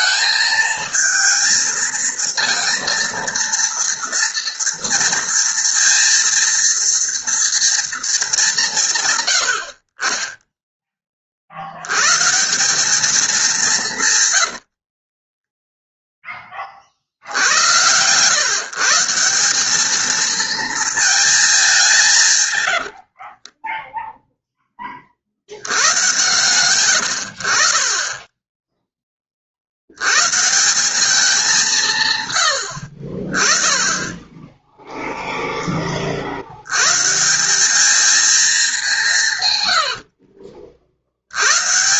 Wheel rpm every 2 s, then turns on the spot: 220, 230, 230, 230, 160, 10, 200, 50, 50, 150, 220, 80, 20, 100, 10, 190, 60, 10, 110, 200, 60.
14-16 22-24